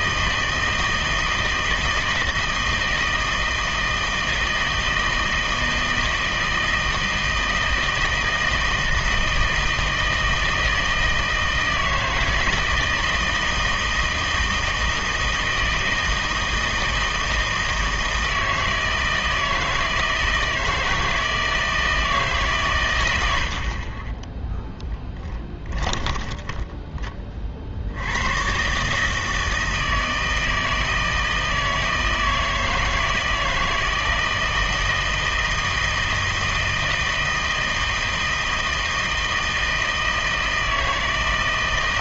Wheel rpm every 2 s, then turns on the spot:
160, 160, 160, 160, 160, 160, 160, 160, 160, 160, 160, 130, 10, 10, 130, 160, 160, 160, 160, 160, 160.
26-28